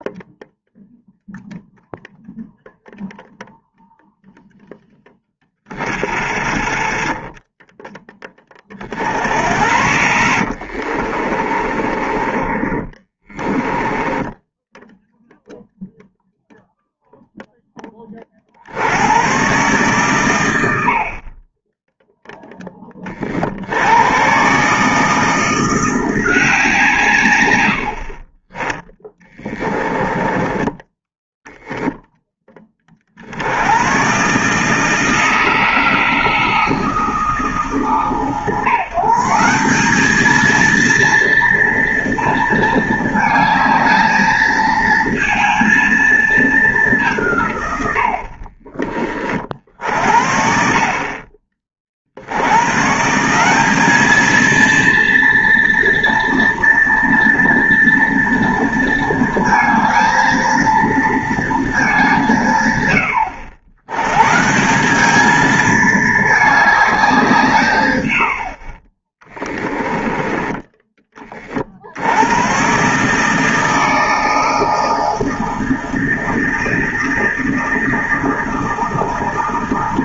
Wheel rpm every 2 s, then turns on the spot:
0, 0, 10, 20, 50, 40, 20, 0, 0, 90, 60, 30, 150, 140, 10, 10, 40, 160, 160, 150, 230, 220, 230, 170, 30, 50, 150, 230, 230, 230, 230, 100, 200, 190, 30, 20, 140, 160, 160, 160.
10-14 28-30